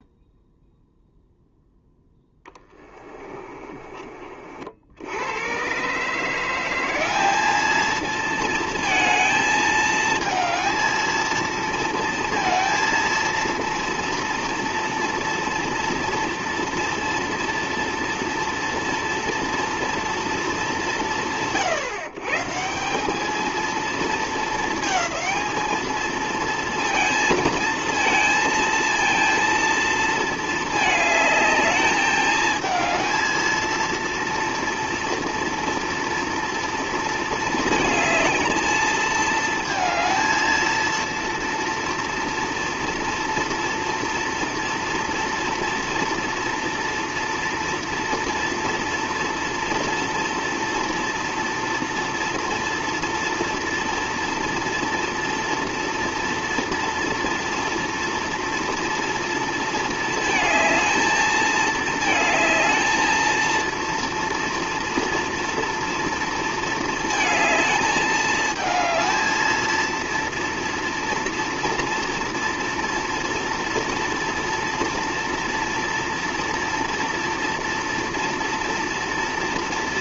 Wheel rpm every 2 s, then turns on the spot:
0, 20, 90, 200, 220, 220, 230, 230, 230, 230, 130, 200, 220, 230, 230, 220, 220, 230, 230, 220, 230, 230, 230, 240, 230, 230, 230, 230, 230, 230, 220, 220, 230, 220, 220, 230, 230, 230, 230, 230.
2-4